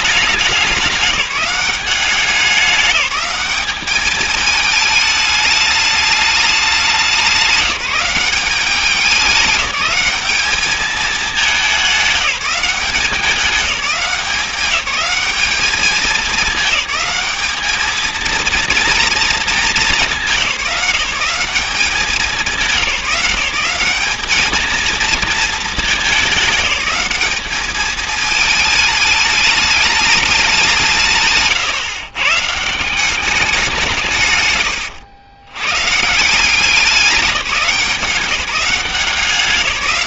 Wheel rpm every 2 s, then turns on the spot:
200, 200, 220, 200, 190, 210, 190, 190, 210, 230, 190, 190, 220, 210, 220, 180, 150, 120, 180, 180.
none